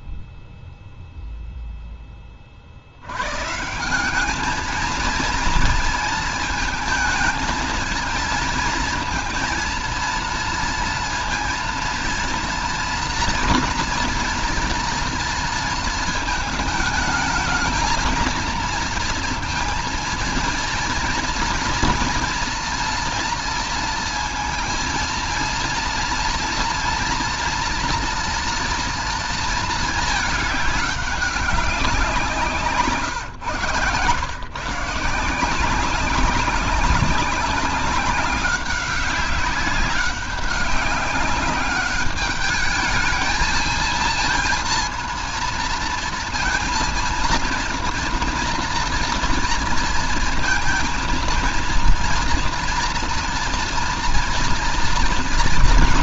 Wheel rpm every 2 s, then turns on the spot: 0, 50, 210, 220, 230, 230, 230, 230, 220, 230, 230, 230, 230, 230, 230, 210, 170, 140, 200, 200, 200, 210, 230, 230, 230, 230, 230, 240.
32-34